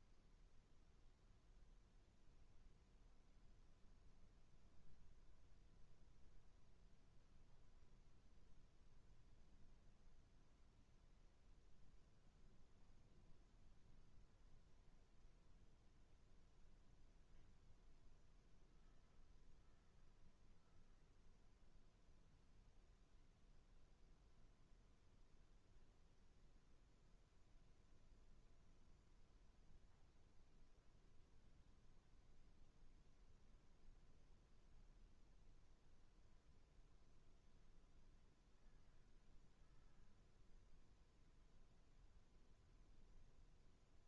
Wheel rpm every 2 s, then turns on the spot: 0, 0, 0, 0, 0, 0, 0, 0, 0, 0, 0, 0, 0, 0, 0, 0, 0, 0, 0, 0, 0, 0.
none